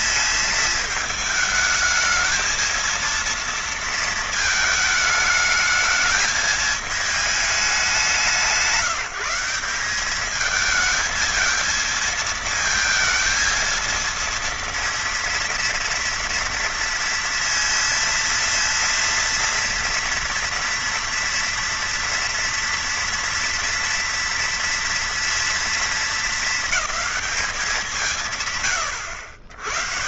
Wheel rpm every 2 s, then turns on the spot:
220, 220, 220, 220, 170, 220, 220, 230, 230, 230, 230, 240, 230, 210, 100.
none